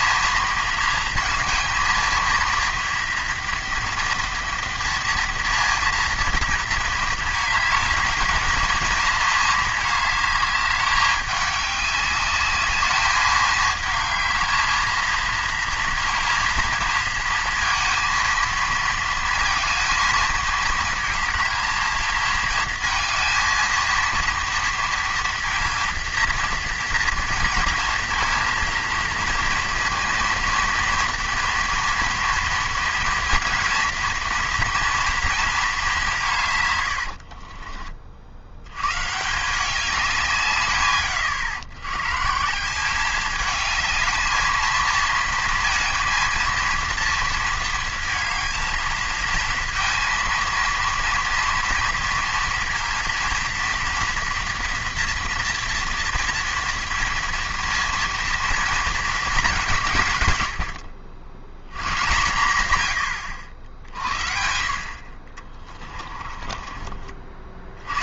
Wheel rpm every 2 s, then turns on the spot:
230, 230, 230, 230, 230, 210, 200, 220, 230, 230, 220, 230, 230, 230, 220, 230, 230, 230, 140, 80, 140, 170, 220, 230, 230, 230, 230, 230, 230, 230, 90, 110, 60, 30.
36-38 66-68